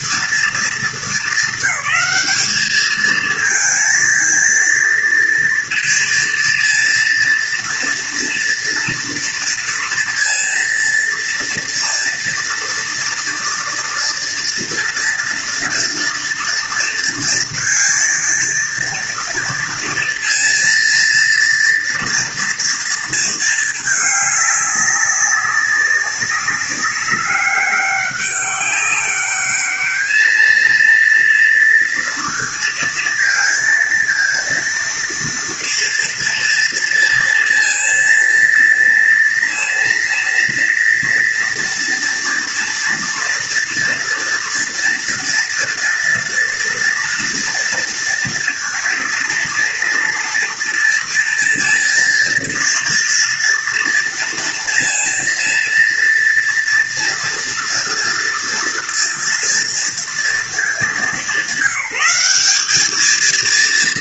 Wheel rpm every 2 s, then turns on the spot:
230, 210, 230, 230, 230, 230, 230, 230, 230, 230, 230, 230, 200, 200, 200, 220, 230, 230, 230, 230, 230, 230, 230, 230, 230, 240, 230, 230, 230, 230, 210, 200.
none